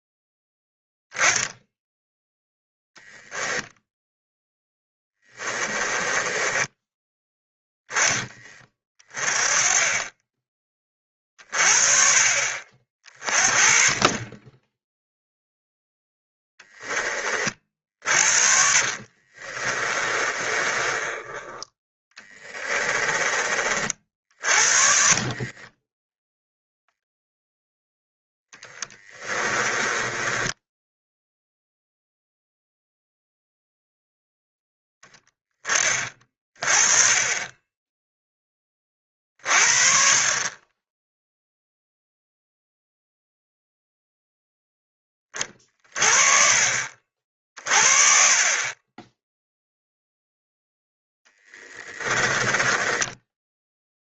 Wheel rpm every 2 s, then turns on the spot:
10, 0, 10, 10, 30, 30, 40, 10, 10, 40, 20, 20, 40, 0, 10, 10, 0, 0, 30, 30, 20, 0, 10, 50, 20, 0, 10.
4-8 18-26 28-32 52-54